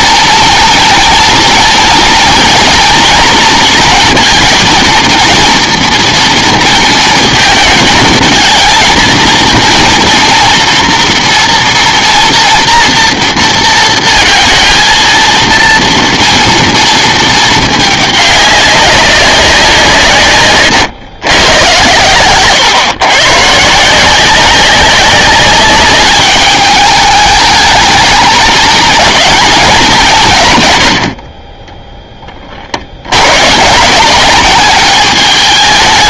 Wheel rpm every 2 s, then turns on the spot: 230, 230, 230, 230, 220, 230, 230, 230, 230, 200, 120, 130, 190, 210, 220, 110, 50, 200.
none